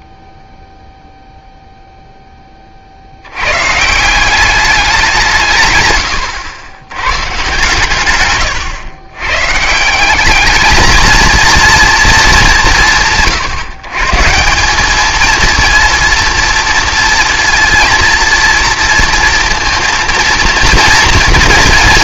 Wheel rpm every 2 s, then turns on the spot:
0, 40, 200, 110, 120, 220, 170, 190, 230, 230, 230.
none